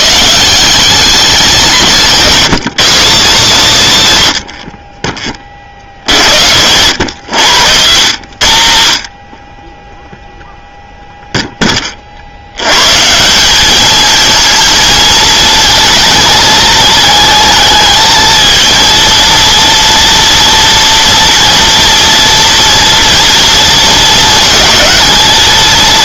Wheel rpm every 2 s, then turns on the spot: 170, 190, 80, 80, 100, 0, 90, 230, 220, 230, 230, 230, 220.
none